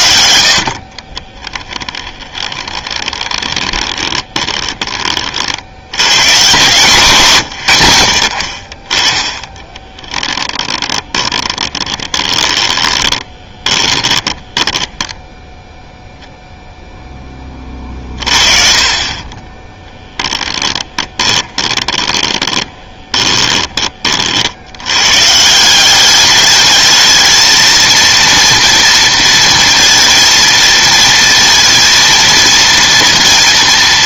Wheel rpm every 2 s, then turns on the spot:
60, 20, 20, 130, 30, 10, 20, 10, 0, 40, 10, 20, 80, 220, 230, 230, 230.
0-4 10-14 20-24